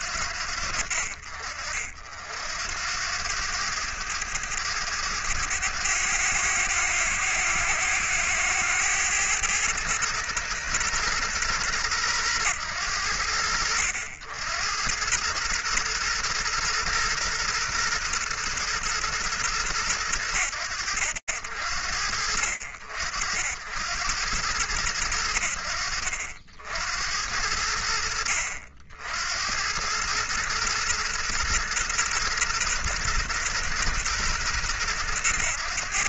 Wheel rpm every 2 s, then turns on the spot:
60, 100, 100, 100, 120, 100, 80, 120, 120, 90, 60, 90, 60, 60, 110, 120, 110, 100.
none